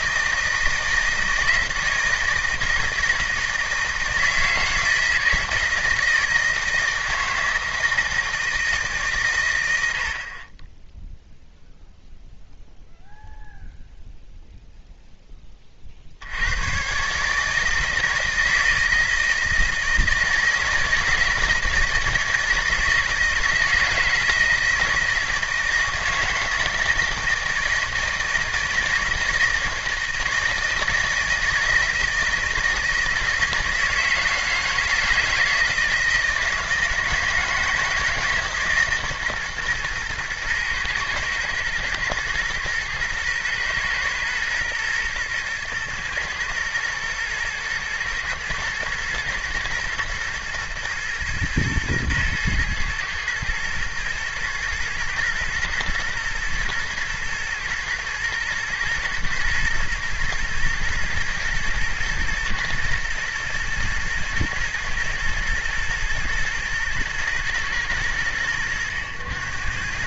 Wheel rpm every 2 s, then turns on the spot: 160, 170, 160, 160, 150, 10, 0, 0, 120, 160, 160, 160, 160, 160, 160, 160, 160, 160, 160, 140, 120, 120, 120, 110, 120, 120, 110, 120, 120, 120, 110, 110, 110, 110, 90.
none